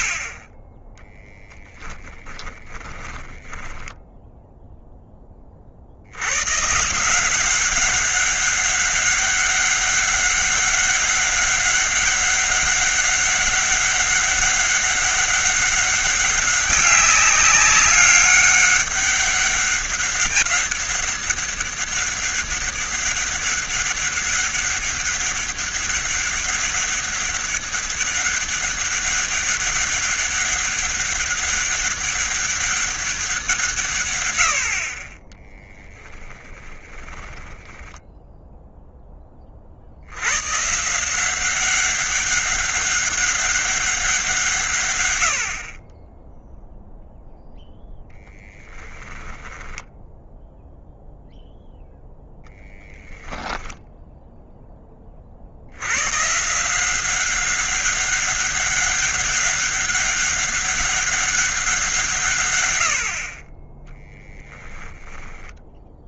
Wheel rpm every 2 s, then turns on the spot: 10, 10, 10, 150, 200, 200, 200, 200, 200, 200, 200, 200, 200, 200, 190, 200, 200, 50, 10, 0, 150, 200, 120, 0, 10, 0, 10, 20, 180, 200, 200, 80, 10.
2-4 34-38 64-66